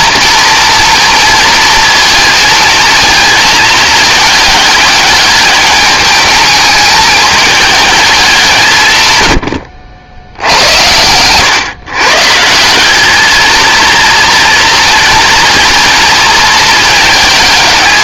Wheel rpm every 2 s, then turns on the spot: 230, 220, 210, 220, 170, 100, 180, 230, 220.
10-12